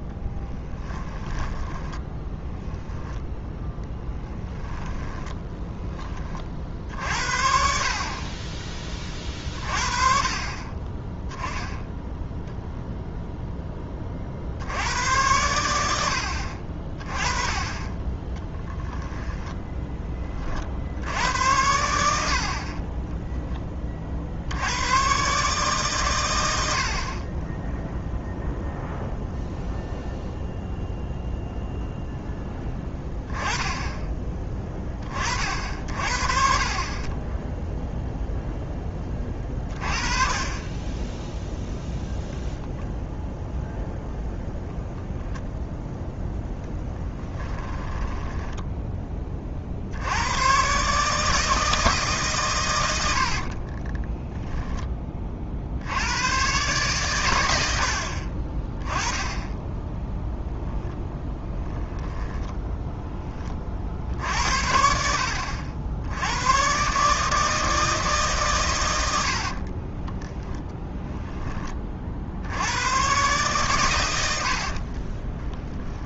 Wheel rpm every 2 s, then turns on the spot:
10, 20, 10, 50, 20, 30, 0, 80, 30, 10, 50, 40, 100, 60, 0, 0, 10, 20, 30, 10, 10, 0, 0, 10, 10, 130, 110, 10, 130, 20, 10, 10, 70, 130, 110, 0, 100, 50.
0-6 18-20 46-48 60-64 74-76